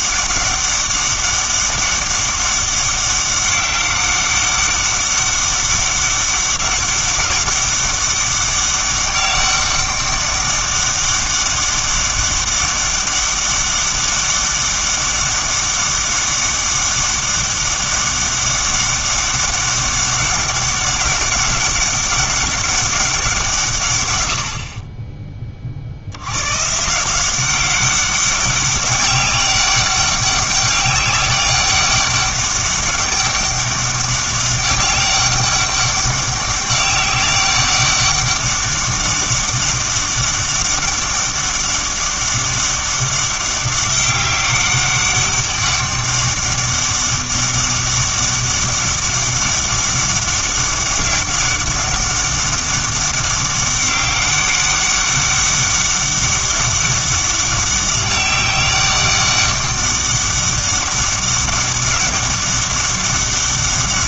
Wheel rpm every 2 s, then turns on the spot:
200, 200, 200, 190, 200, 200, 200, 200, 200, 200, 200, 200, 60, 130, 200, 200, 200, 200, 200, 200, 200, 200, 200, 200, 200, 200, 200, 200, 200, 200, 200, 200.
none